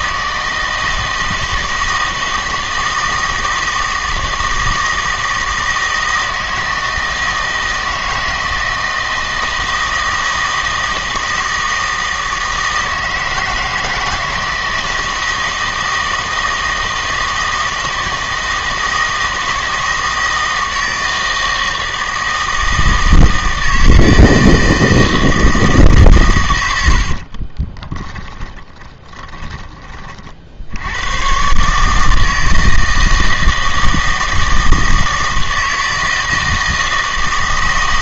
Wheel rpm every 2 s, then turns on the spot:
160, 160, 160, 160, 160, 160, 160, 160, 160, 160, 160, 160, 160, 100, 20, 70, 160, 160, 160.
28-30